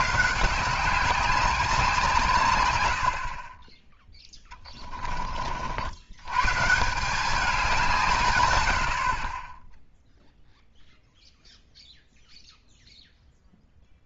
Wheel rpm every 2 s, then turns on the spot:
160, 120, 20, 150, 90, 0, 0.
4-6